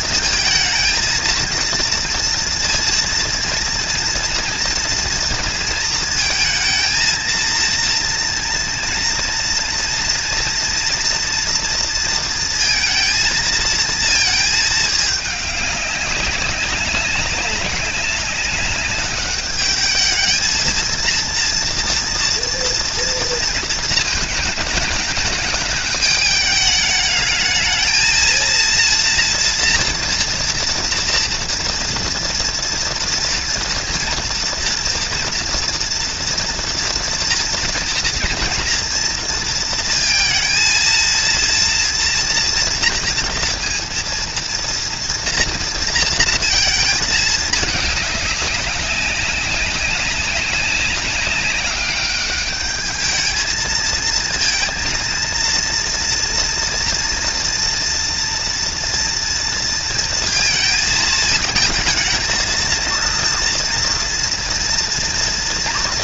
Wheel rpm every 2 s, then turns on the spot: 230, 230, 230, 230, 230, 230, 230, 220, 200, 200, 220, 240, 220, 210, 220, 230, 230, 230, 240, 230, 220, 230, 230, 230, 200, 200, 200, 230, 230, 230, 230, 220, 230.
none